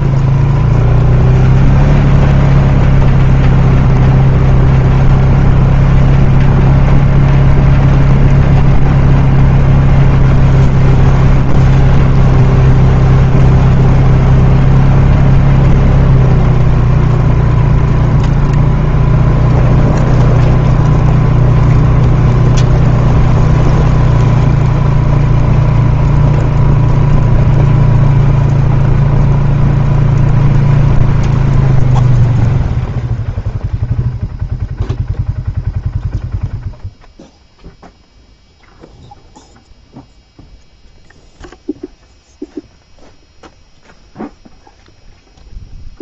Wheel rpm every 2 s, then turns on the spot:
0, 0, 0, 0, 0, 0, 0, 0, 0, 0, 0, 0, 0, 0, 0, 0, 0, 0, 0, 0, 0, 0, 0.
none